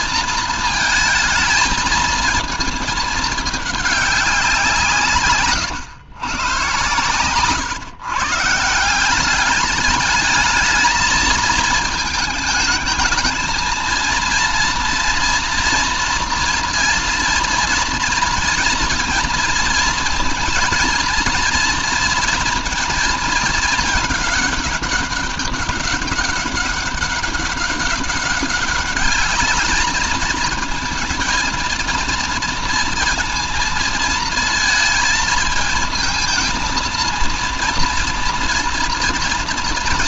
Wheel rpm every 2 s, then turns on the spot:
220, 220, 160, 110, 170, 220, 220, 240, 230, 230, 230, 230, 210, 200, 200, 230, 230, 230, 230, 230.
6-8